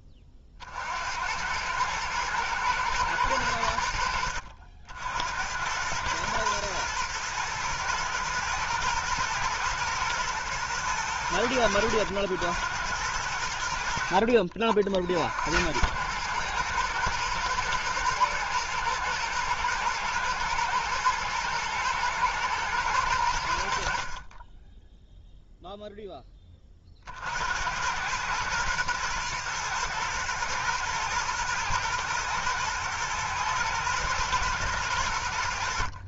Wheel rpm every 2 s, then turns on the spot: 50, 120, 70, 110, 120, 110, 100, 50, 110, 110, 110, 110, 10, 40, 110, 110, 110, 110.
none